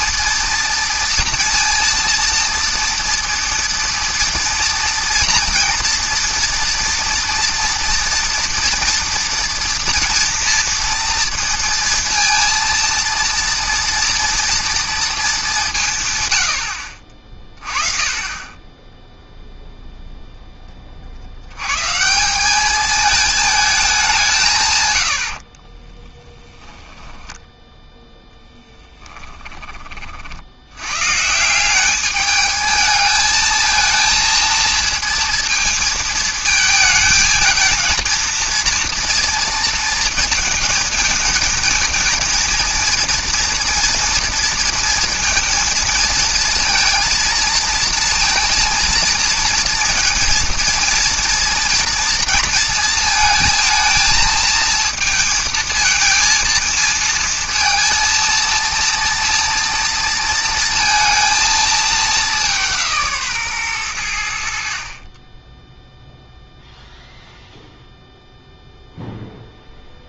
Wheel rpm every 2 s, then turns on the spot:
230, 230, 230, 230, 230, 230, 230, 230, 80, 20, 20, 200, 130, 10, 10, 90, 210, 230, 220, 230, 220, 230, 230, 230, 230, 230, 230, 220, 230, 230, 230, 180, 60, 0, 0.
26-30